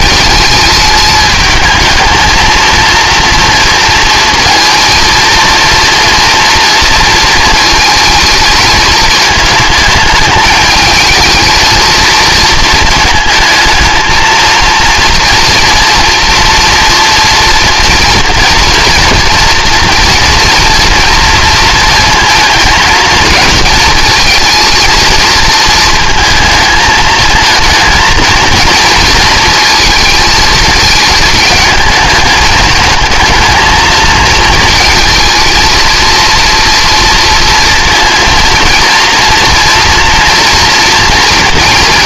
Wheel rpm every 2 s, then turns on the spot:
210, 230, 230, 230, 220, 220, 220, 230, 230, 230, 230, 220, 220, 220, 230, 220, 220, 220, 230, 230, 230.
none